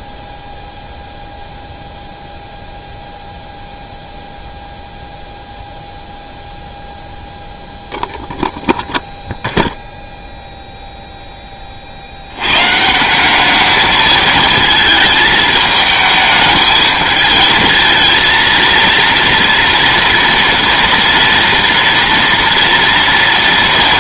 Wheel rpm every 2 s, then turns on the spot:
0, 0, 0, 0, 0, 0, 140, 220, 220, 230, 230, 230.
none